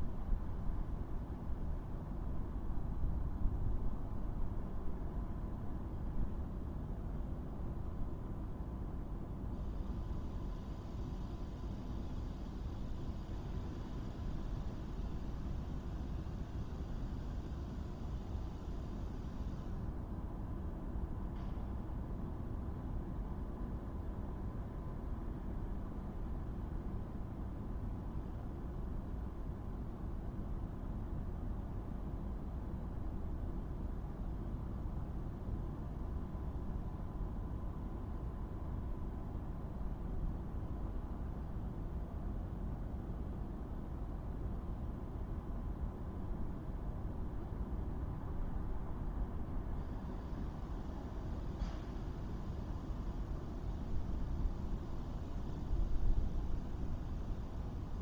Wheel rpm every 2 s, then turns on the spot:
0, 0, 0, 0, 0, 0, 0, 0, 0, 0, 0, 0, 0, 0, 0, 0, 0, 0, 0, 0, 0, 0, 0, 0, 0, 0, 0, 0, 0.
none